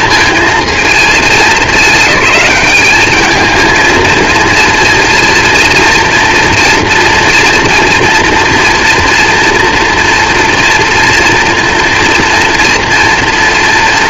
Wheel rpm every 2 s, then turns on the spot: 230, 200, 230, 230, 230, 230, 230.
none